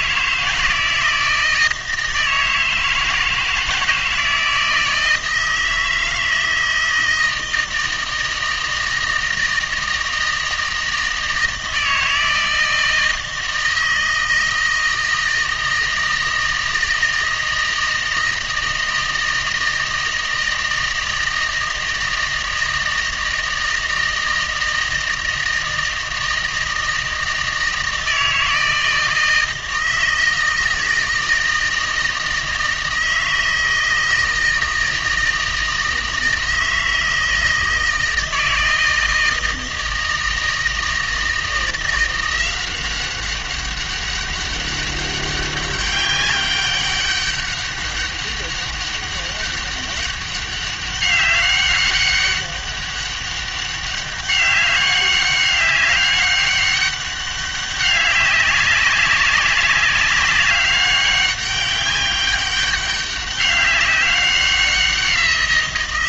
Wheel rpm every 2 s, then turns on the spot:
160, 160, 160, 160, 160, 160, 160, 160, 160, 160, 160, 160, 160, 160, 160, 160, 160, 160, 160, 160, 160, 180, 200, 200, 200, 200, 200, 190, 200, 200, 190, 200, 180.
none